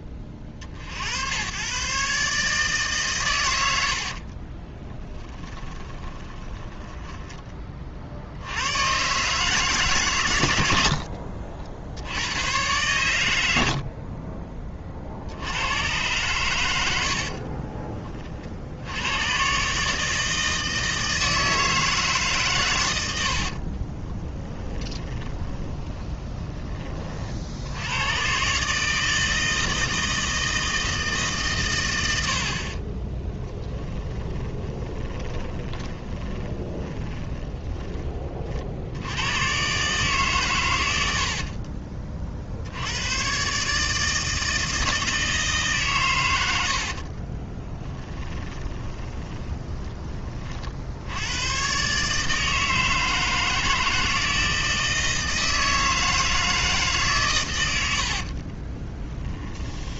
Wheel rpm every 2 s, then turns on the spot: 40, 140, 20, 10, 110, 90, 110, 30, 90, 80, 160, 110, 20, 30, 150, 160, 30, 20, 20, 70, 100, 80, 160, 70, 20, 60, 160, 160, 150, 30.
4-8 16-18 24-26 32-38 46-50 58-60